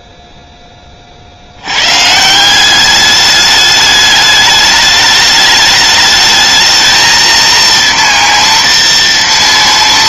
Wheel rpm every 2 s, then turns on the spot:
80, 210, 210, 230, 230.
none